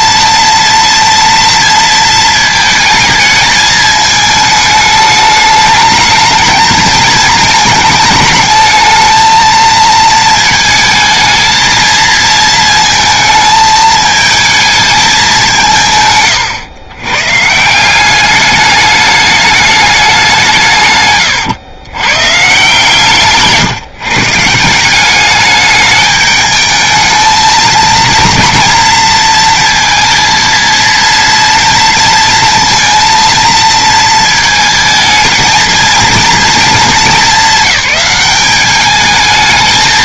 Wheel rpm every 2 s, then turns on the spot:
240, 220, 220, 220, 220, 220, 220, 220, 120, 210, 160, 140, 160, 210, 230, 230, 230, 230, 230, 210.
none